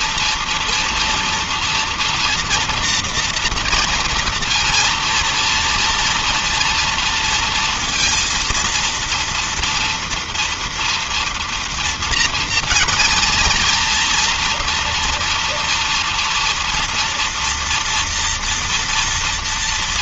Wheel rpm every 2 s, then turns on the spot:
230, 230, 230, 230, 230, 230, 230, 240, 240, 230.
none